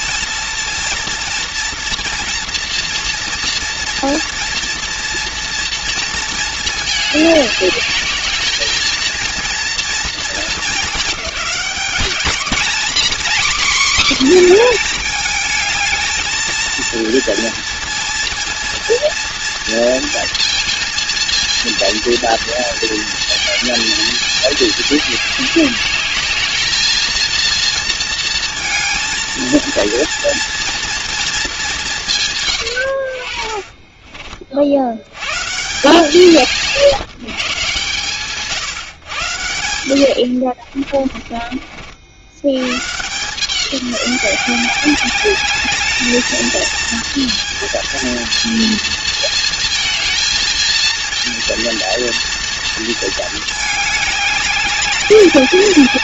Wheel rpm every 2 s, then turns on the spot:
230, 230, 240, 210, 220, 210, 250, 230, 230, 230, 230, 220, 210, 220, 230, 230, 70, 90, 160, 130, 50, 150, 200, 230, 220, 230, 230, 200.
40-42